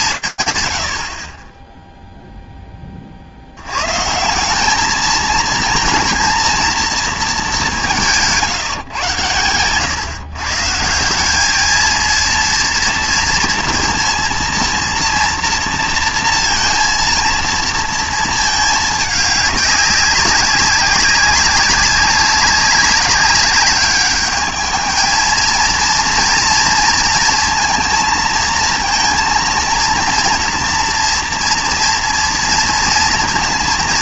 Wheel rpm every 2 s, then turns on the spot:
120, 20, 200, 230, 140, 160, 230, 230, 230, 220, 190, 190, 220, 240, 230, 230, 230.
none